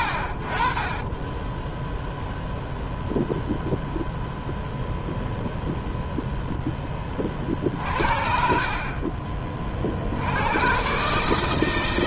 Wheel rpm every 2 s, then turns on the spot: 50, 0, 0, 0, 50, 110.
none